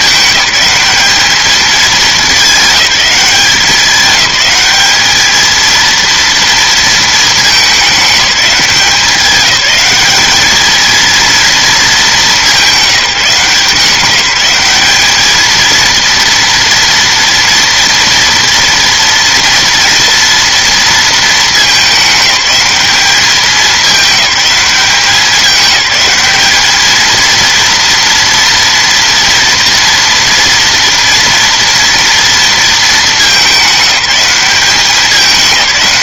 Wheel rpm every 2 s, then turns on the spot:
210, 200, 210, 230, 190, 220, 190, 190, 230, 230, 230, 210, 200, 210, 230, 230, 220, 190.
none